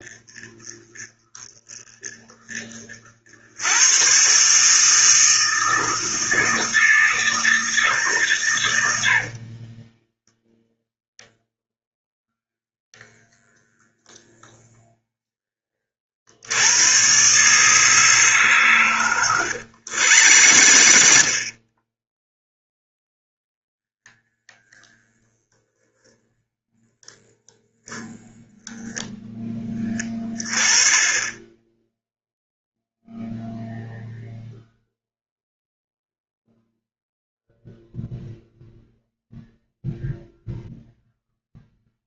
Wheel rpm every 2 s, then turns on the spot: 30, 50, 160, 160, 80, 0, 0, 0, 110, 120, 70, 0, 0, 0, 0, 10, 0, 0, 0, 0, 0.
8-10 18-22